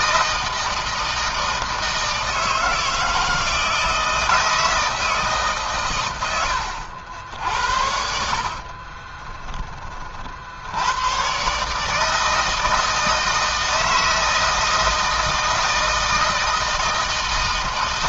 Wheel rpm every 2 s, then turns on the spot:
160, 160, 160, 80, 30, 110, 160, 160, 160.
8-10